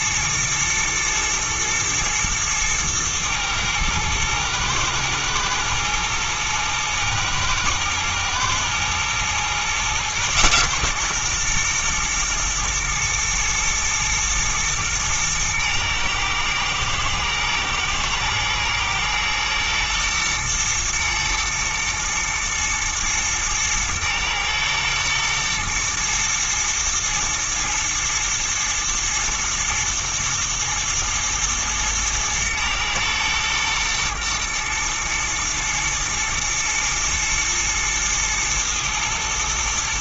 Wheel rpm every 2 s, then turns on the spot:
120, 110, 110, 110, 110, 130, 110, 110, 110, 120, 110, 110, 110, 110, 120, 110, 110, 120, 120, 110.
none